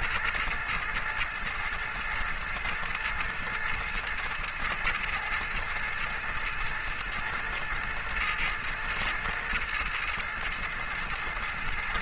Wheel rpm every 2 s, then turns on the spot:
110, 110, 110, 110, 110, 110.
none